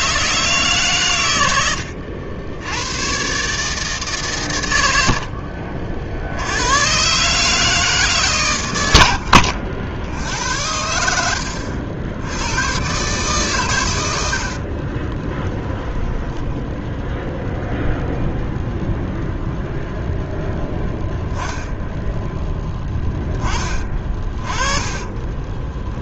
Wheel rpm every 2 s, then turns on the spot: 130, 110, 90, 120, 100, 80, 130, 30, 0, 0, 0, 10, 30.
14-16 24-26